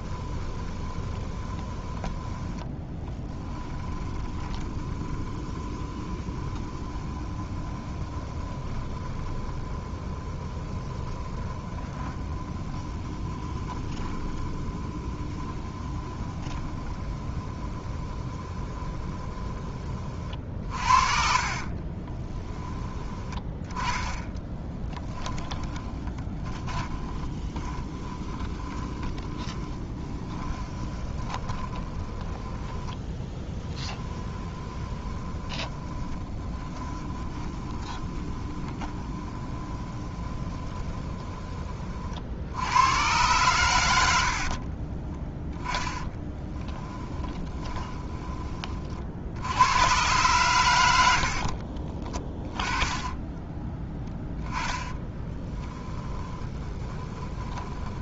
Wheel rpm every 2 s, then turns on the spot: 20, 20, 20, 20, 20, 20, 20, 20, 20, 20, 50, 20, 10, 20, 20, 20, 10, 20, 20, 20, 20, 100, 20, 10, 40, 100, 20, 10, 20.
0-22 24-42 44-48 54-58